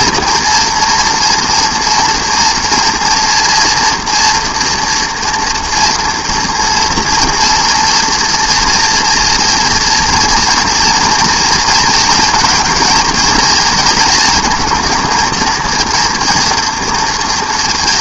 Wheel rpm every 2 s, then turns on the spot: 230, 240, 230, 230, 230, 230, 230, 230, 230.
none